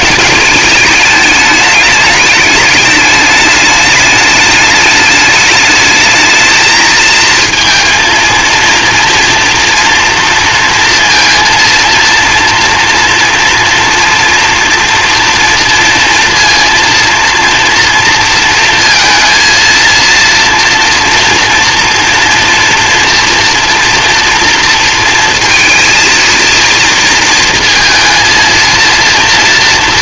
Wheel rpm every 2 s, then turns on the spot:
210, 210, 210, 220, 230, 230, 230, 230, 230, 230, 230, 230, 230, 230, 230.
none